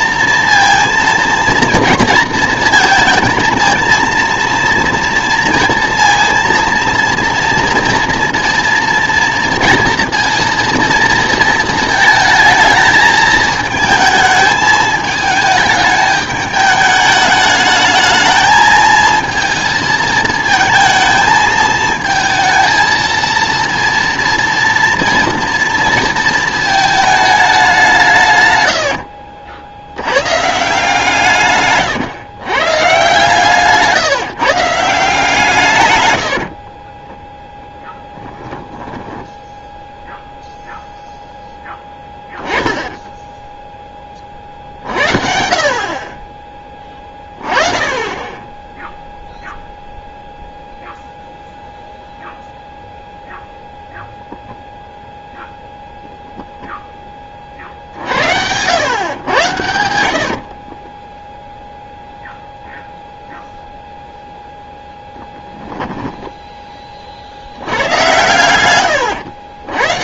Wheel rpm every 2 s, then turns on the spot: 230, 220, 230, 230, 230, 230, 220, 220, 210, 220, 230, 230, 230, 220, 100, 150, 130, 160, 30, 10, 0, 10, 50, 20, 10, 0, 0, 0, 0, 100, 30, 0, 0, 20, 110.
28-30 38-40 60-62